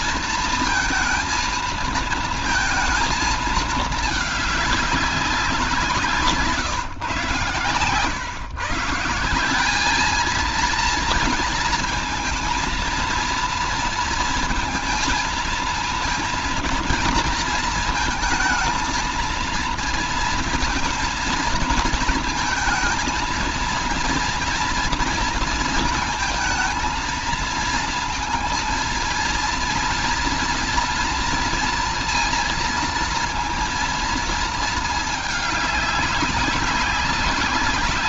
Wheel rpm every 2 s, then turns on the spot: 230, 220, 200, 160, 120, 220, 230, 230, 230, 220, 230, 230, 230, 230, 230, 230, 230, 230, 200.
none